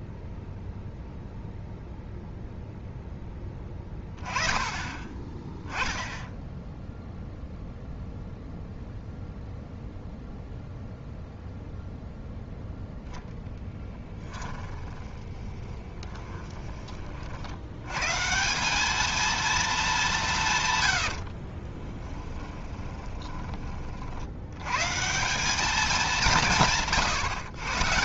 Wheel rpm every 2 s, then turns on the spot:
0, 0, 10, 0, 0, 0, 0, 20, 20, 200, 110, 20, 120, 150.
14-16 22-24